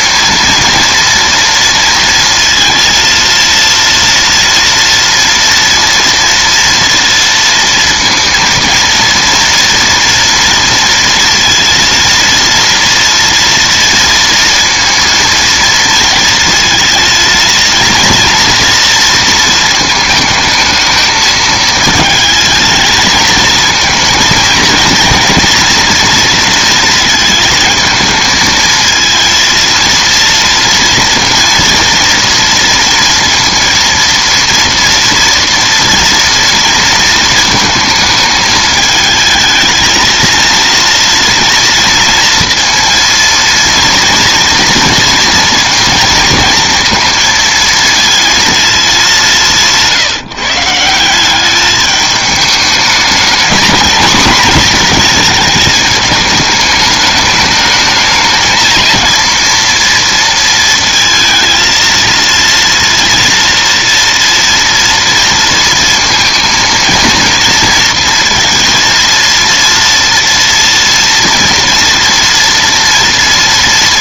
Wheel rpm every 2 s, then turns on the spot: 230, 230, 230, 230, 230, 230, 230, 230, 230, 230, 220, 220, 230, 230, 230, 230, 230, 230, 220, 220, 230, 230, 230, 230, 210, 160, 220, 240, 210, 230, 230, 230, 230, 230, 230, 240, 240.
none